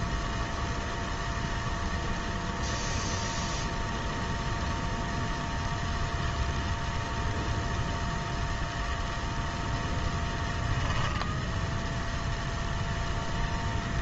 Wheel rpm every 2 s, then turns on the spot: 0, 0, 0, 0, 0, 0, 0.
none